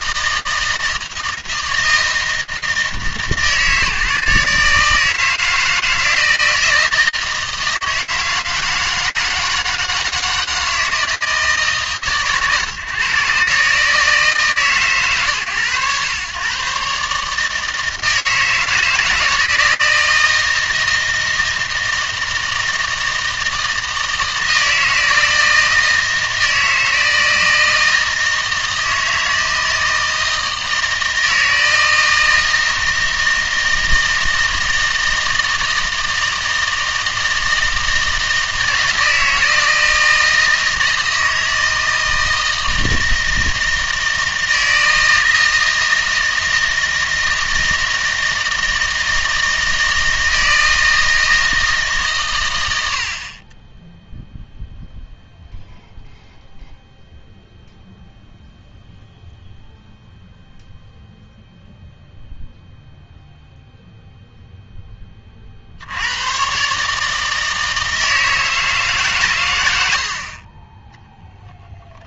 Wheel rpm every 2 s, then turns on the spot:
160, 160, 150, 160, 160, 160, 130, 140, 130, 160, 160, 160, 160, 160, 160, 160, 160, 160, 160, 160, 160, 160, 160, 160, 160, 160, 100, 0, 0, 0, 0, 0, 10, 130, 160, 10.
none